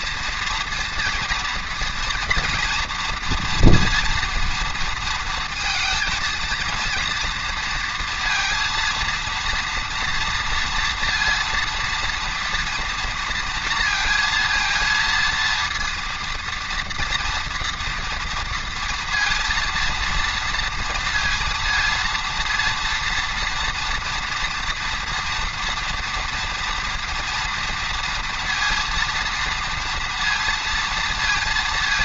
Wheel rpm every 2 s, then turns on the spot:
230, 240, 230, 230, 230, 230, 240, 230, 230, 230, 230, 230, 230, 230, 230, 230.
none